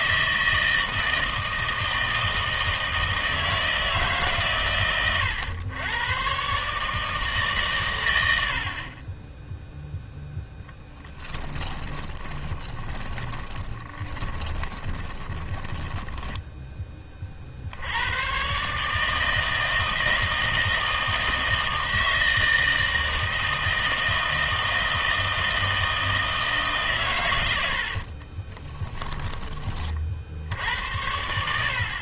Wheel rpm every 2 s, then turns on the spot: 160, 160, 120, 150, 50, 10, 20, 20, 20, 150, 160, 160, 160, 140, 10, 80.
10-16 28-30